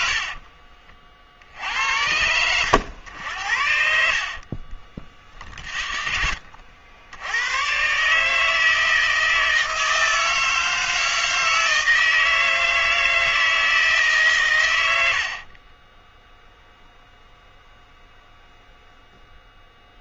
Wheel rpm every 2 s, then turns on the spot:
60, 90, 40, 70, 160, 160, 160, 110, 0, 0.
0-2 4-6